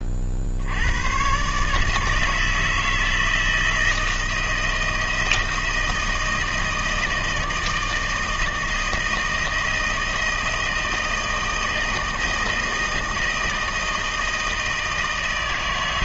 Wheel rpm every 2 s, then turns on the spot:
110, 160, 160, 160, 160, 160, 160, 160.
none